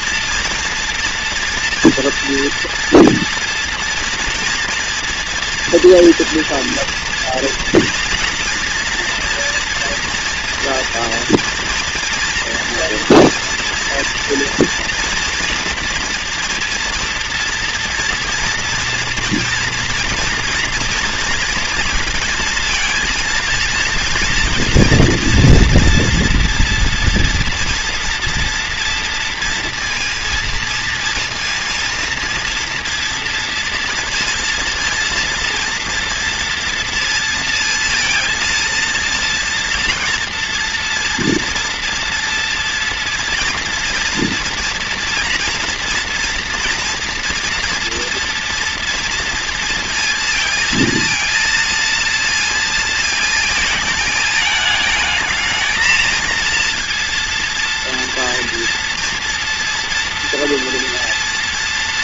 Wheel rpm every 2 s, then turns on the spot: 240, 230, 230, 230, 230, 230, 230, 230, 230, 240, 230, 230, 230, 230, 240, 230, 230, 230, 230, 230, 230, 230, 230, 240, 230, 230, 230, 220, 230, 230, 240.
none